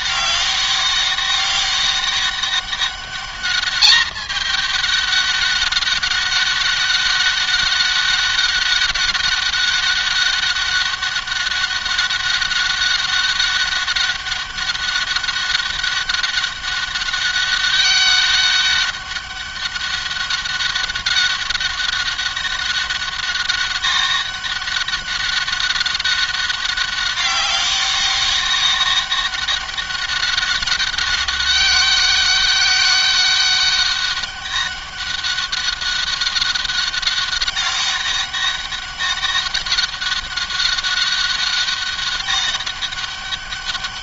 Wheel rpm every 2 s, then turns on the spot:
200, 200, 210, 200, 200, 200, 200, 200, 200, 200, 200, 200, 190, 190, 200, 200, 200, 200, 200, 200, 200, 200.
none